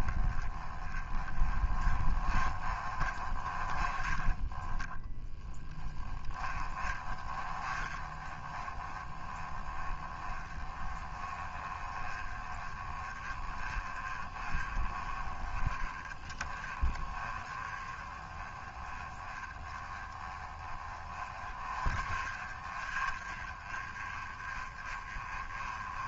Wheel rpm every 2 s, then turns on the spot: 20, 30, 10, 20, 20, 20, 20, 20, 20, 20, 20, 30, 20.
none